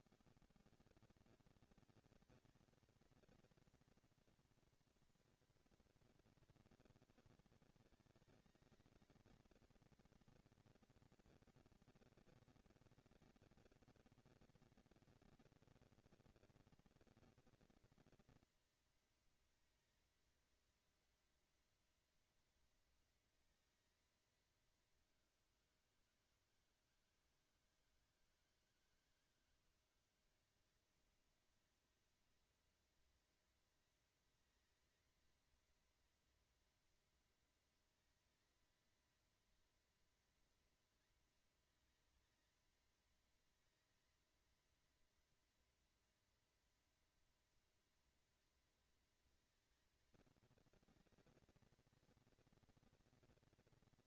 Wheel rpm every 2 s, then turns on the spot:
150, 220, 230, 130, 220, 230, 230, 230, 230, 230, 230, 230, 200, 160, 160, 210, 230, 230, 230, 230, 230, 220, 230, 230, 230, 230, 230.
none